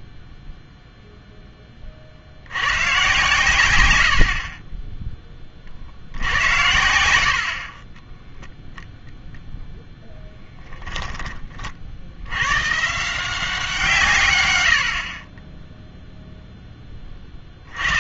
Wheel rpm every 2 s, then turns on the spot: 0, 90, 30, 80, 0, 20, 120, 110, 0.
10-12